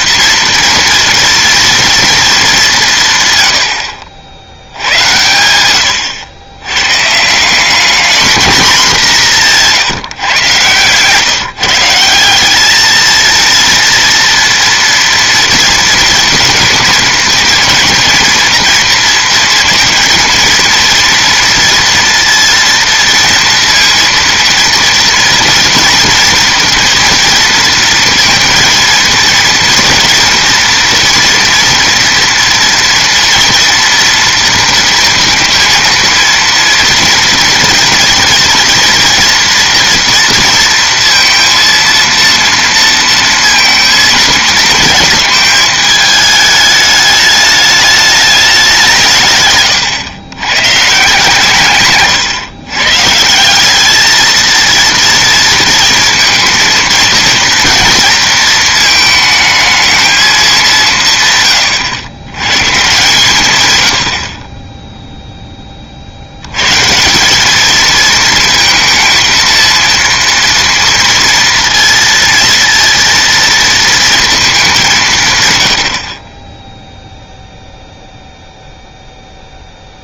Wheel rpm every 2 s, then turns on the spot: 230, 190, 80, 120, 210, 120, 200, 230, 230, 230, 230, 230, 230, 230, 230, 230, 230, 230, 230, 240, 230, 230, 220, 210, 180, 140, 130, 230, 230, 220, 180, 130, 10, 140, 230, 230, 230, 200, 10, 0.
none